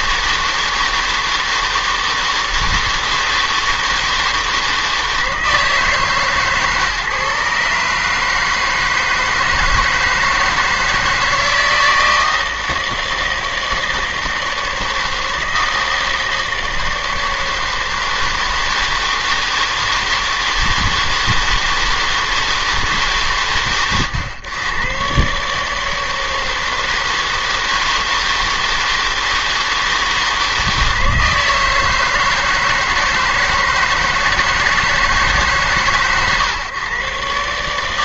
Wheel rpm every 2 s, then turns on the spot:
160, 160, 160, 140, 160, 160, 160, 160, 160, 160, 160, 160, 110, 160, 160, 160, 160, 160, 130.
none